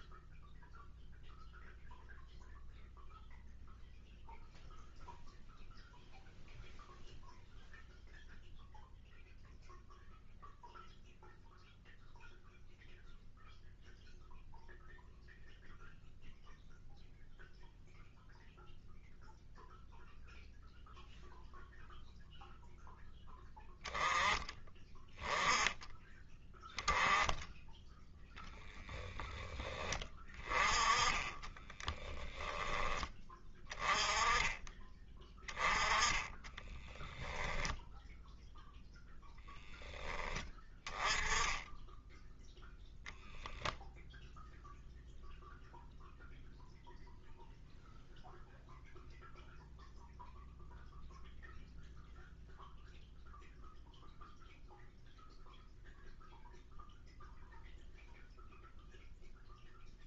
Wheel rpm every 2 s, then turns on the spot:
0, 0, 0, 0, 0, 0, 0, 0, 0, 0, 0, 0, 10, 10, 10, 20, 10, 20, 10, 0, 10, 0, 0, 0, 0, 0, 0, 0, 0, 0.
36-38